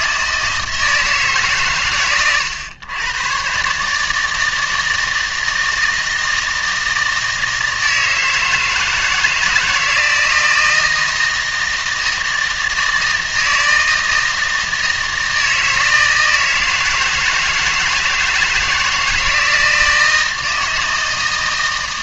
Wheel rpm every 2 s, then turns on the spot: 160, 110, 160, 160, 160, 160, 160, 160, 160, 160, 160.
none